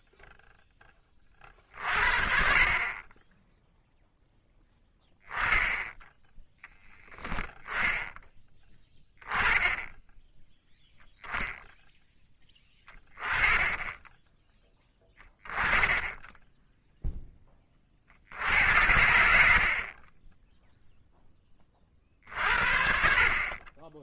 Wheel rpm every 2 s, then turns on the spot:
0, 60, 10, 10, 10, 0, 10, 20, 10, 80, 10, 50.
none